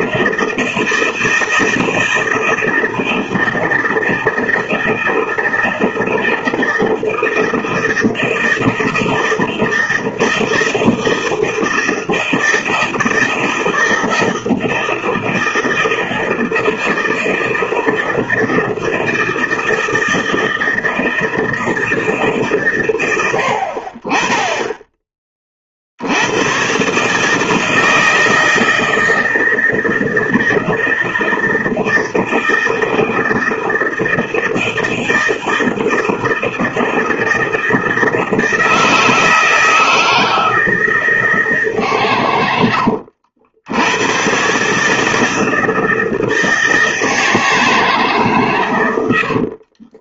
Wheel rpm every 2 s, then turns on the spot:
160, 160, 160, 160, 160, 160, 160, 160, 160, 160, 160, 120, 20, 140, 160, 160, 160, 160, 160, 160, 160, 80, 150, 160, 100.
42-44